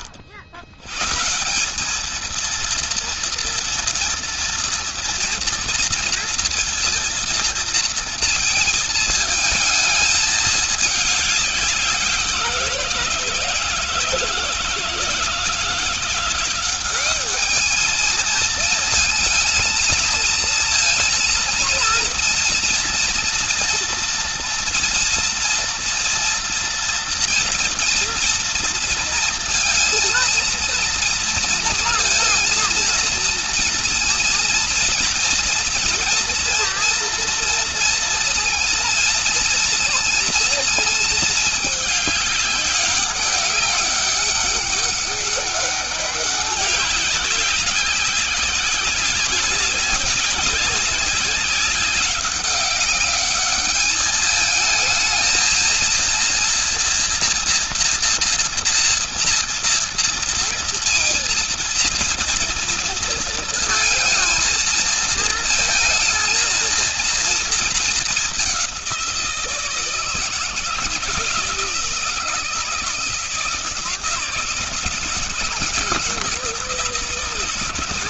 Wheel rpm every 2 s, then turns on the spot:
110, 230, 230, 230, 220, 210, 170, 160, 190, 220, 230, 230, 230, 230, 230, 230, 230, 230, 230, 230, 220, 200, 200, 200, 190, 190, 200, 220, 230, 230, 230, 230, 230, 230, 190, 160, 160, 150, 150.
none